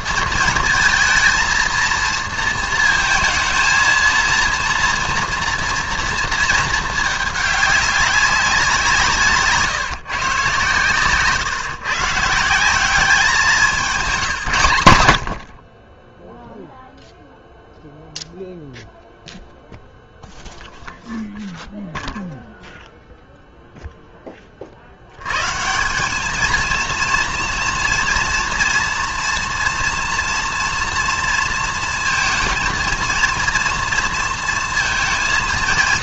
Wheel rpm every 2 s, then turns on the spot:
220, 230, 230, 220, 190, 140, 170, 150, 0, 0, 0, 0, 40, 220, 230, 230, 220, 220.
none